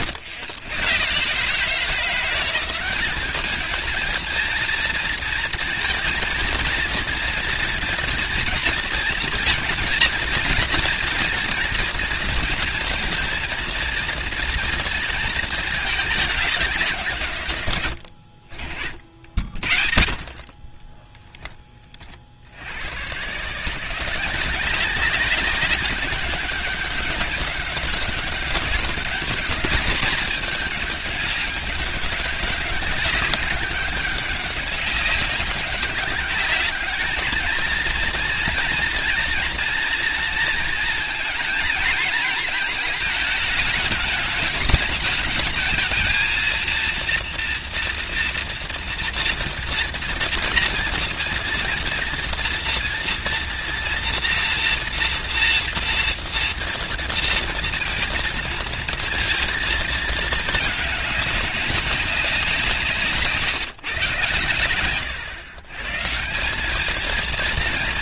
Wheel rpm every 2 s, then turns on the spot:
120, 180, 230, 220, 230, 230, 230, 230, 190, 60, 40, 60, 190, 200, 190, 210, 190, 200, 200, 230, 230, 230, 210, 230, 230, 230, 230, 240, 230, 230, 220, 180, 120, 180.
none